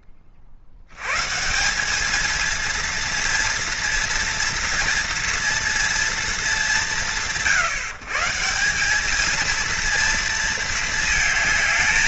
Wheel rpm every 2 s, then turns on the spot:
80, 230, 240, 180, 200, 230.
none